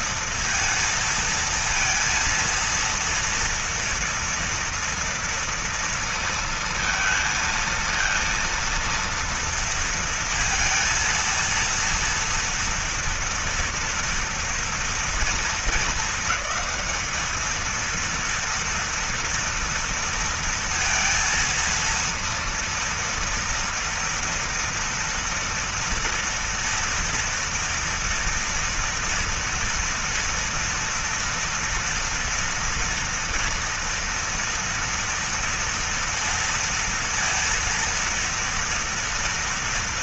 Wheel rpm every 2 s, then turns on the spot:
230, 230, 230, 230, 230, 230, 240, 230, 220, 230, 230, 230, 230, 230, 230, 230, 230, 230, 230, 230.
none